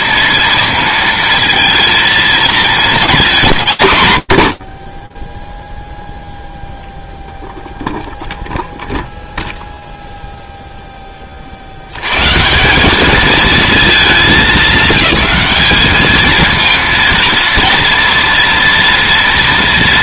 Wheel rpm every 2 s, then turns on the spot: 230, 220, 60, 0, 0, 0, 200, 190, 230, 230.
none